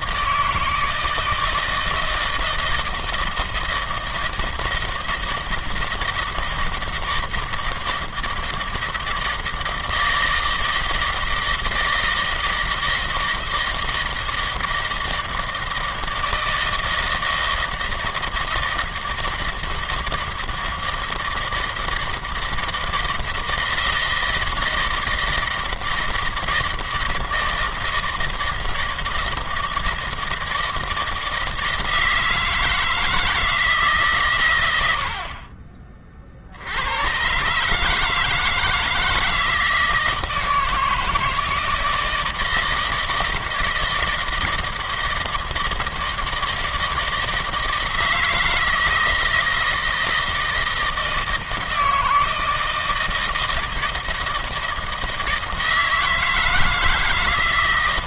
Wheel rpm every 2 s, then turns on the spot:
160, 160, 160, 160, 160, 160, 160, 160, 160, 160, 160, 160, 160, 160, 160, 160, 160, 80, 100, 160, 160, 160, 160, 160, 160, 160, 160, 160, 160.
none